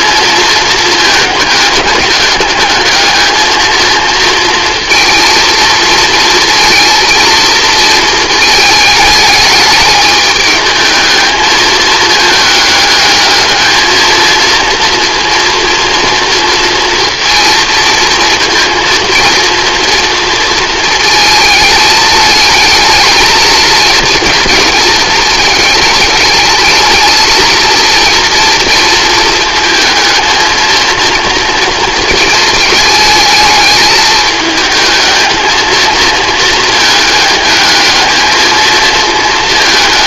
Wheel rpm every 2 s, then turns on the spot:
220, 210, 230, 230, 220, 210, 220, 230, 230, 230, 230, 220, 230, 210, 230, 230, 220, 220, 220, 220.
none